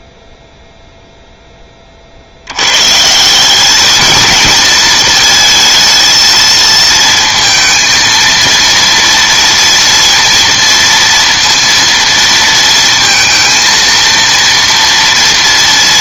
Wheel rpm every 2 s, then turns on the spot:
0, 100, 220, 230, 230, 230, 230, 230.
none